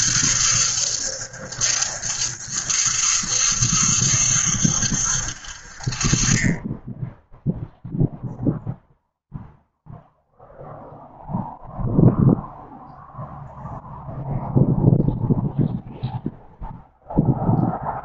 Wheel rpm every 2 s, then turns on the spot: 70, 70, 70, 10, 0, 0, 0, 0, 0.
none